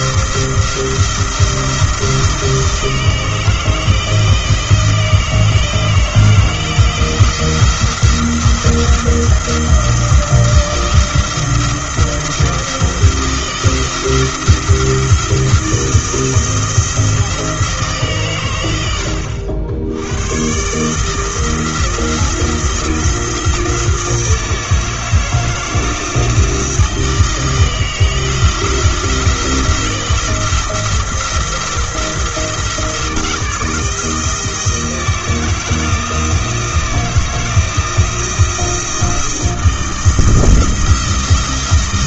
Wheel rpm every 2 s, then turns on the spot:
170, 160, 160, 170, 170, 170, 160, 160, 170, 110, 120, 170, 160, 170, 170, 170, 170, 170, 170, 170, 170.
none